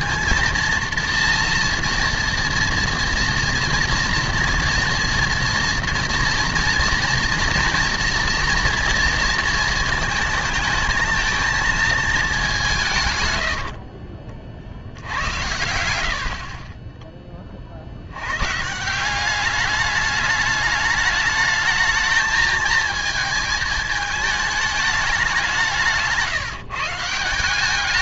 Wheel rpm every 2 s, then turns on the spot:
230, 240, 230, 230, 230, 220, 180, 60, 40, 140, 210, 220, 210, 150.
none